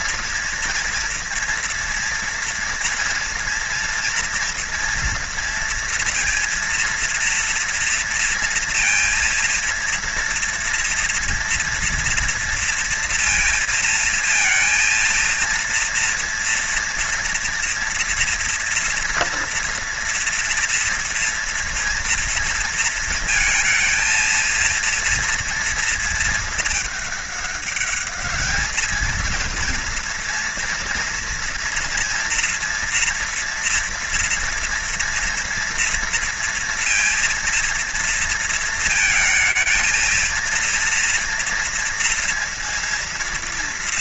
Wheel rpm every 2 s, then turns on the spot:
230, 230, 230, 230, 230, 240, 240, 230, 240, 240, 230, 230, 230, 220, 210, 230, 230, 230, 230, 230, 230, 230.
none